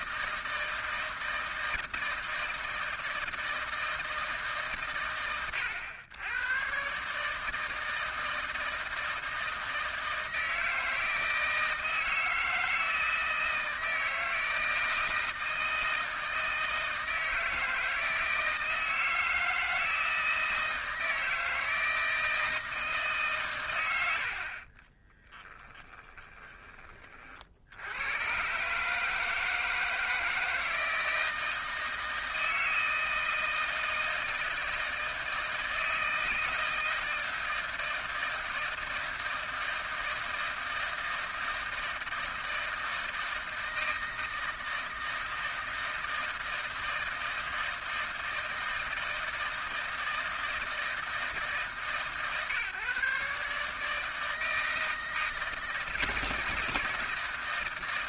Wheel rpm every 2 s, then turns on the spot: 160, 160, 130, 120, 160, 160, 160, 160, 160, 160, 160, 160, 40, 20, 140, 160, 160, 160, 160, 160, 160, 160, 160, 160, 160, 160, 140, 160, 160.
24-26